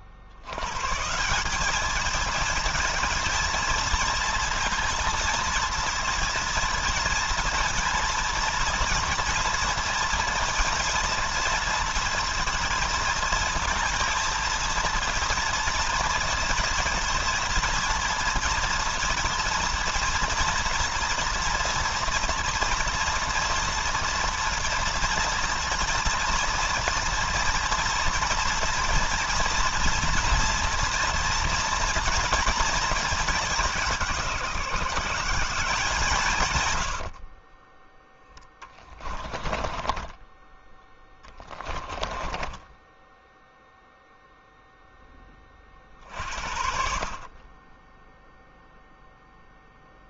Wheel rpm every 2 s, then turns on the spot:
140, 220, 230, 230, 240, 230, 230, 230, 220, 230, 230, 240, 240, 230, 240, 230, 230, 170, 80, 30, 10, 10, 10, 50, 0.
36-40 42-44